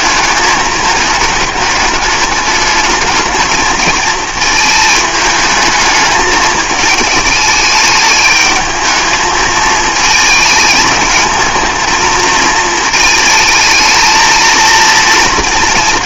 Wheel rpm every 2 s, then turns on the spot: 220, 210, 220, 220, 210, 220, 220, 230.
none